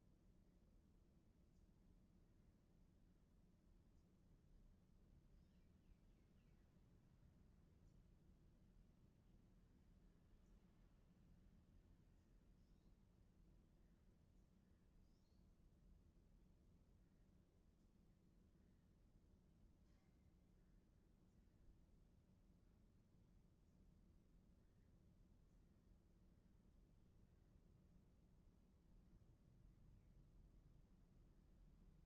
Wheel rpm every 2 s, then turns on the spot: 0, 0, 0, 0, 0, 0, 0, 0, 0, 0, 0, 0, 0, 0, 0, 0.
none